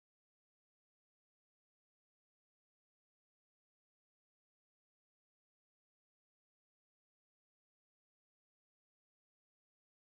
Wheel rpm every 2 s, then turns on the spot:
0, 0, 0, 0, 0.
none